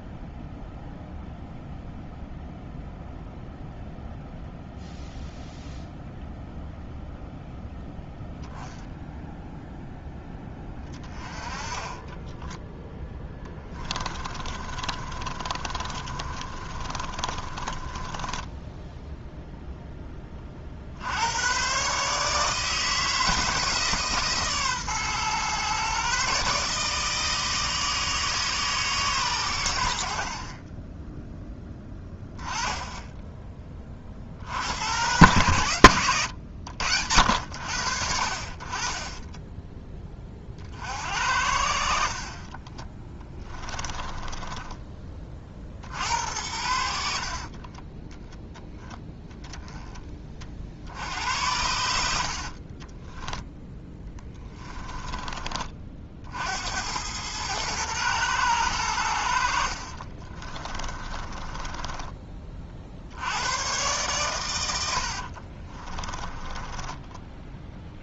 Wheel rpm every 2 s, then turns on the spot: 0, 0, 0, 0, 0, 20, 20, 30, 30, 10, 60, 160, 130, 150, 150, 30, 10, 80, 90, 30, 50, 20, 20, 70, 20, 50, 40, 20, 80, 100, 20, 50, 90, 10.
12-20 42-44 52-56 60-62 66-68